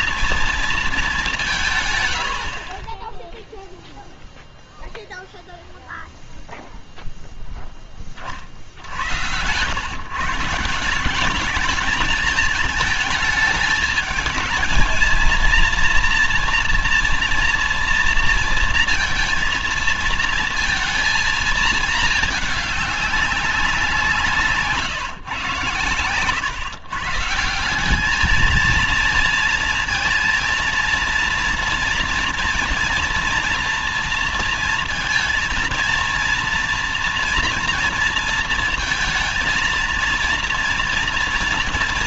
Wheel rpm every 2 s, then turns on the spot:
230, 40, 0, 0, 50, 160, 220, 220, 230, 230, 220, 200, 160, 120, 220, 240, 230, 230, 230, 230, 240.
none